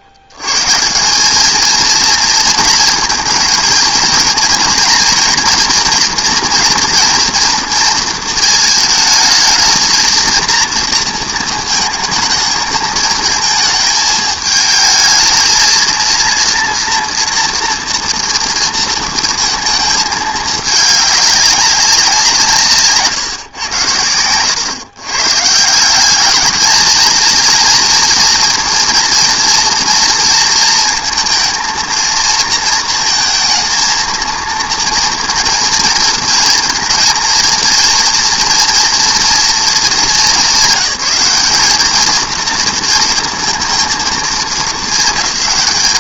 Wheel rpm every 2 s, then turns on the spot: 90, 230, 240, 240, 220, 230, 220, 220, 230, 230, 210, 150, 110, 210, 230, 230, 230, 230, 230, 230, 200, 230, 210.
none